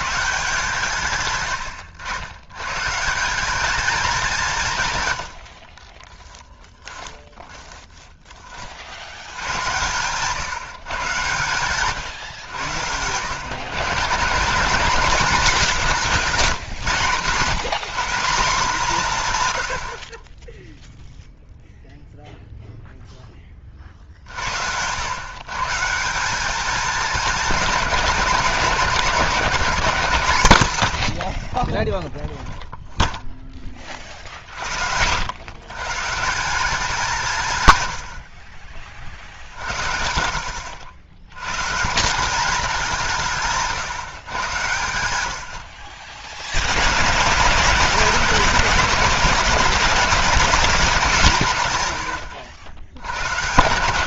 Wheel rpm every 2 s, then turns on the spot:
150, 120, 160, 10, 40, 130, 100, 190, 150, 180, 10, 0, 80, 220, 200, 150, 0, 70, 200, 40, 80, 200, 110, 90, 170, 200, 90.
6-8